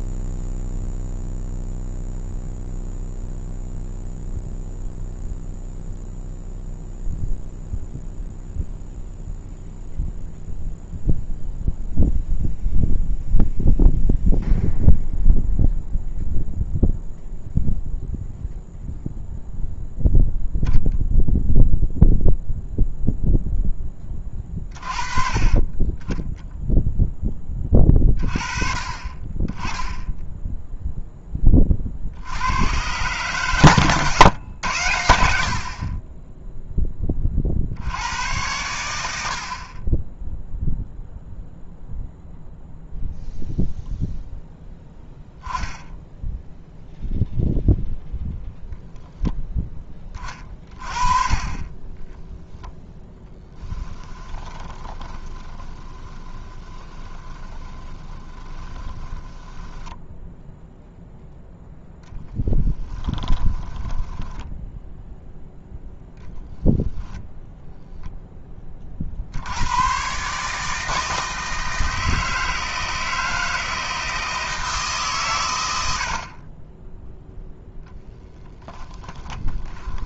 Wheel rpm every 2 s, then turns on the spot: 0, 0, 0, 0, 0, 0, 0, 0, 0, 0, 0, 0, 30, 0, 30, 10, 120, 90, 10, 80, 0, 0, 10, 0, 0, 30, 10, 20, 20, 20, 0, 10, 0, 0, 40, 160, 160, 160, 10, 20.
54-60 62-64 78-80